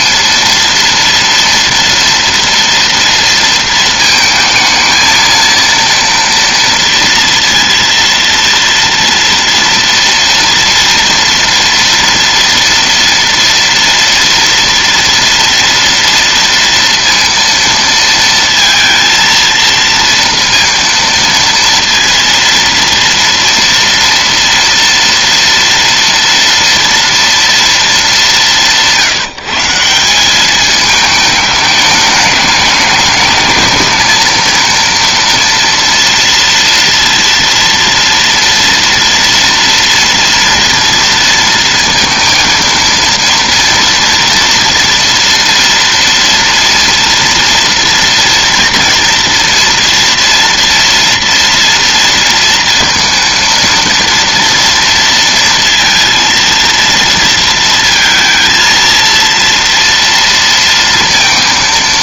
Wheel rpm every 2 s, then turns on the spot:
230, 230, 220, 230, 230, 230, 230, 230, 230, 230, 230, 230, 230, 230, 170, 210, 210, 230, 230, 230, 230, 230, 230, 240, 230, 230, 230, 230, 230, 230, 230.
none